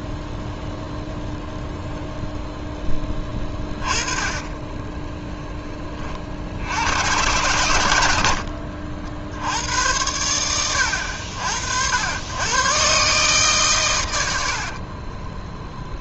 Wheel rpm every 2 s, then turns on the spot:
0, 10, 20, 80, 60, 90, 120, 60.
4-6 8-10 14-16